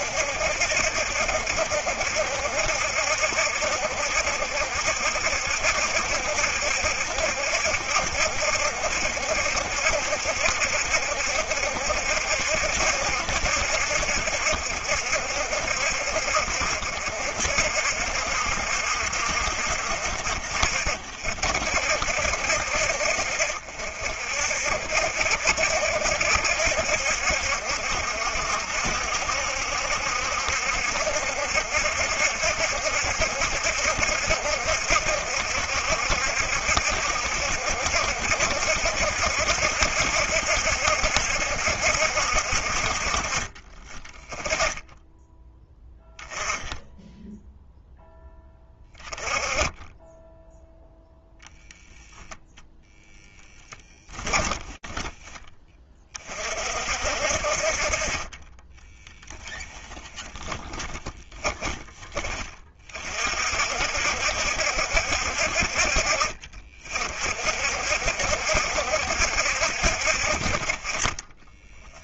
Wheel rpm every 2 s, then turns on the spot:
70, 70, 70, 70, 70, 70, 70, 70, 60, 70, 50, 60, 60, 70, 70, 70, 70, 70, 70, 70, 70, 60, 10, 0, 10, 0, 0, 20, 40, 20, 20, 30, 60, 50, 60, 40.
54-56 58-62